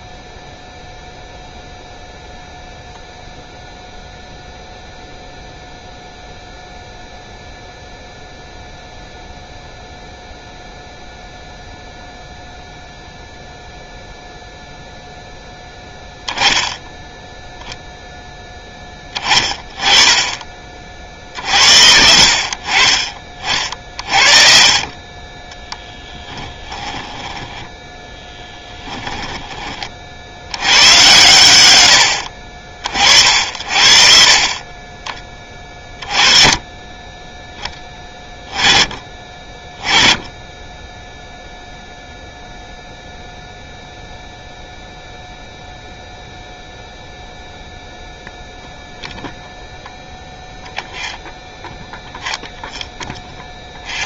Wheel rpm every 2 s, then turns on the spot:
0, 0, 0, 0, 0, 0, 0, 0, 0, 20, 50, 40, 40, 10, 10, 100, 50, 30, 20, 20, 10, 0, 0, 0, 0, 0, 0.
26-30